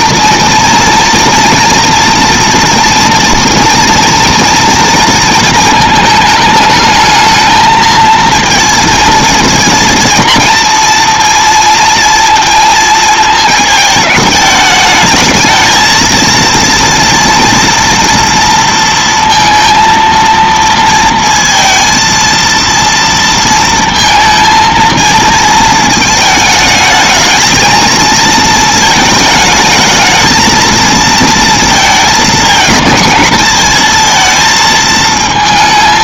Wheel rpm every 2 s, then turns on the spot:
240, 240, 230, 220, 230, 230, 230, 210, 230, 230, 230, 230, 230, 220, 220, 230, 220, 220.
none